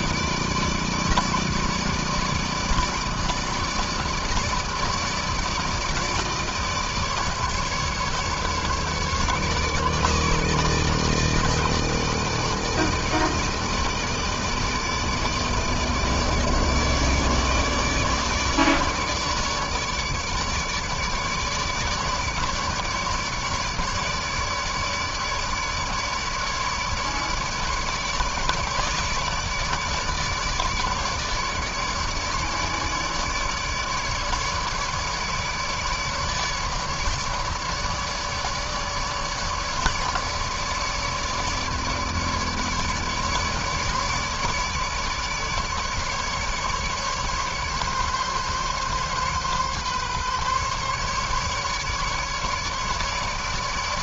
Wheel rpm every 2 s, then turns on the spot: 160, 160, 160, 160, 150, 160, 160, 150, 150, 150, 150, 150, 150, 150, 150, 150, 150, 150, 150, 150, 150, 150, 150, 140, 140, 140, 150.
none